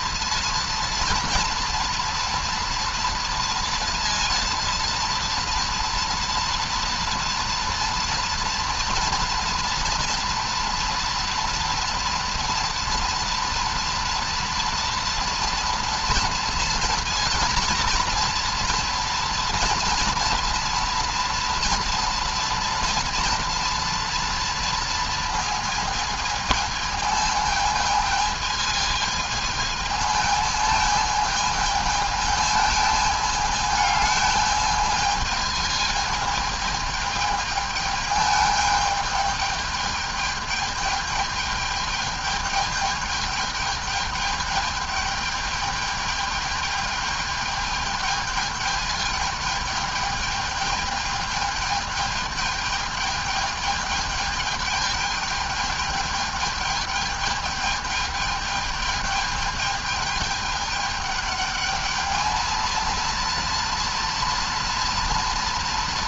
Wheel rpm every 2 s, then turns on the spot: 230, 240, 230, 230, 230, 230, 240, 230, 230, 230, 230, 230, 230, 220, 220, 220, 220, 210, 210, 210, 210, 210, 210, 210, 220, 210, 210, 210, 210, 210, 210, 220, 230.
none